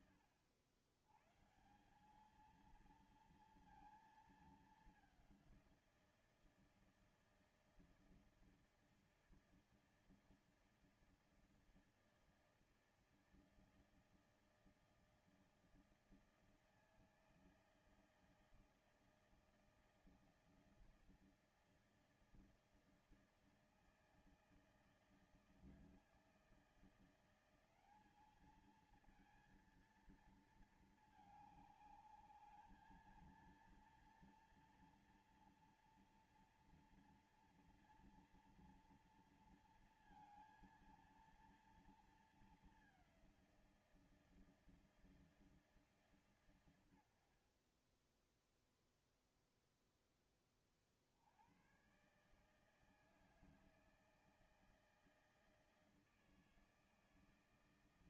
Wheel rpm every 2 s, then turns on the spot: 110, 230, 200, 160, 160, 160, 160, 160, 160, 160, 160, 160, 160, 170, 220, 220, 220, 230, 230, 230, 230, 200, 160, 100, 0, 40, 150, 160, 160.
none